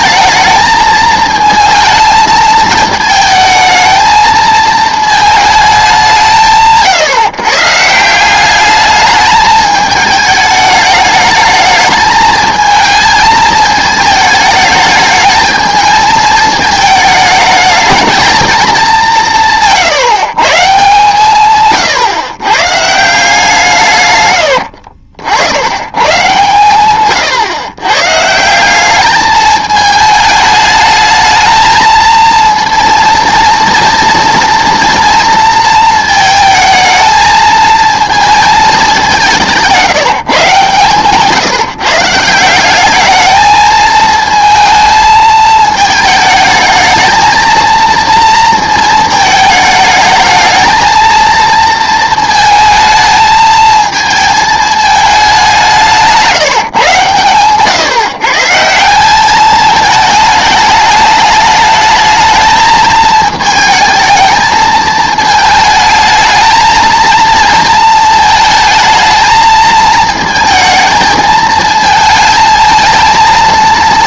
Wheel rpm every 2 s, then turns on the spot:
220, 220, 220, 140, 200, 210, 220, 210, 220, 210, 140, 130, 80, 130, 180, 210, 230, 230, 220, 210, 150, 180, 220, 220, 230, 220, 220, 220, 160, 160, 210, 220, 220, 220, 220, 220, 220.
24-26